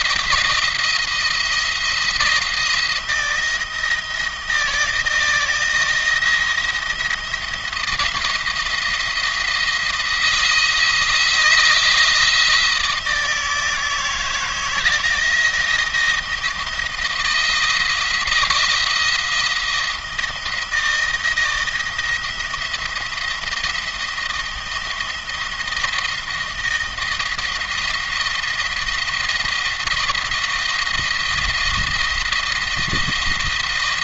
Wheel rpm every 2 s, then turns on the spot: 170, 160, 160, 170, 170, 160, 160, 160, 160, 170, 170, 170, 170, 170, 170, 170, 170.
none